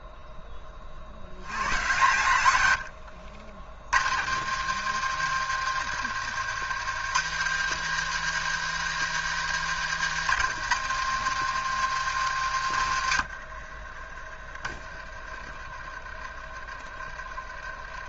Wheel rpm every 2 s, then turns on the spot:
20, 100, 130, 130, 170, 140, 110, 30, 30.
2-4